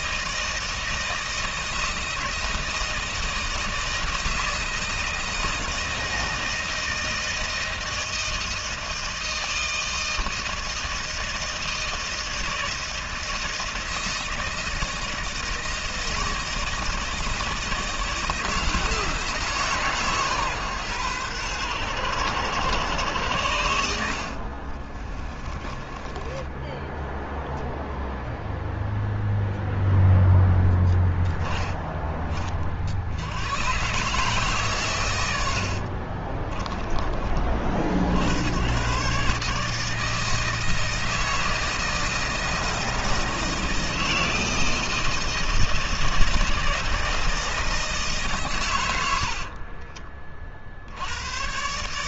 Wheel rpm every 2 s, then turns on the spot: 160, 160, 160, 160, 160, 160, 160, 160, 160, 160, 130, 100, 50, 10, 0, 0, 20, 130, 40, 80, 160, 160, 160, 160, 130, 40.
24-28 36-38